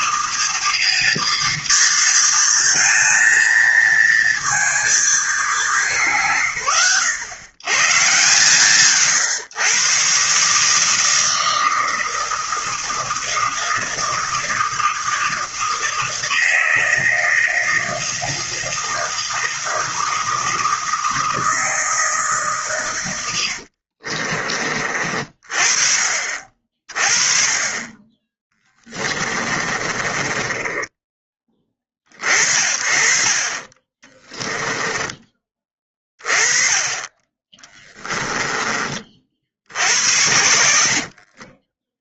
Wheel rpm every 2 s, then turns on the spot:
230, 220, 230, 100, 140, 130, 160, 160, 160, 160, 160, 150, 40, 40, 30, 20, 40, 10, 30, 10, 80.
24-26 28-32 34-36 38-42